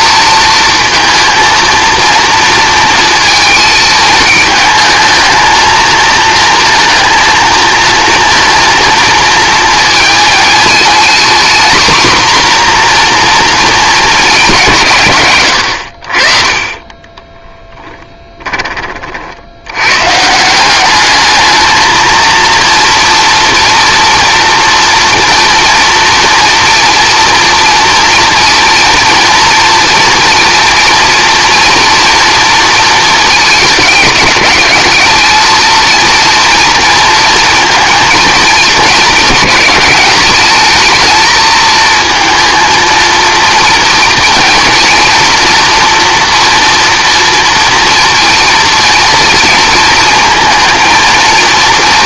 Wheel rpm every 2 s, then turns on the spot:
230, 230, 220, 230, 230, 230, 250, 190, 40, 20, 180, 230, 230, 230, 230, 230, 230, 210, 230, 220, 220, 230, 230, 230, 230, 230.
none